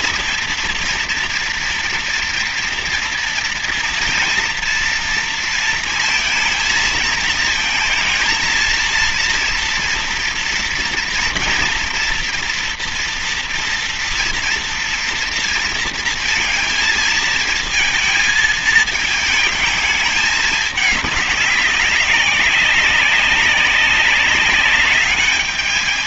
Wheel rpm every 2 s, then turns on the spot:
240, 230, 230, 220, 230, 230, 230, 230, 230, 220, 210, 190, 200.
none